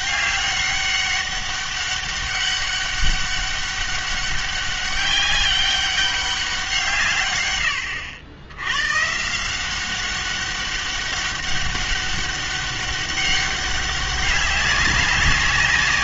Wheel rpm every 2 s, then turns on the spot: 200, 200, 200, 170, 110, 200, 200, 190.
none